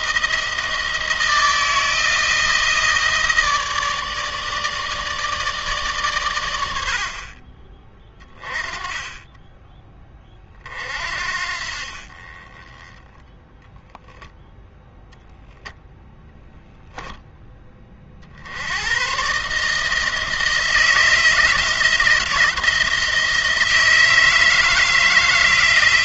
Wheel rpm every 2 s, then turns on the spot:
160, 160, 150, 80, 20, 40, 20, 10, 0, 90, 160, 160, 160.
none